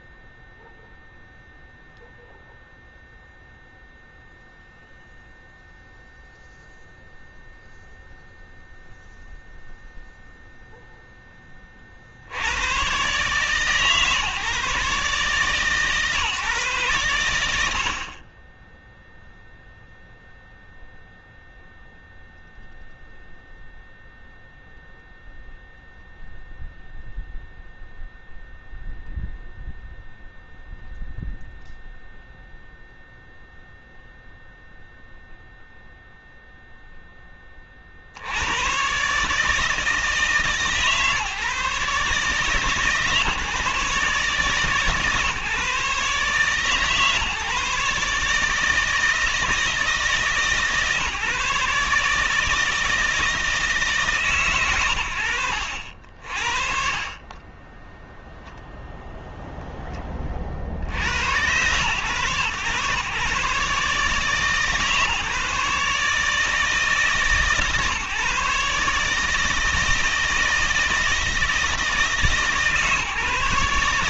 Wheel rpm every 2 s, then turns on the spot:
0, 0, 0, 0, 0, 0, 110, 150, 120, 10, 0, 0, 0, 0, 0, 0, 0, 0, 0, 110, 140, 150, 150, 150, 160, 140, 160, 110, 50, 0, 60, 120, 150, 150, 140, 160, 150.
none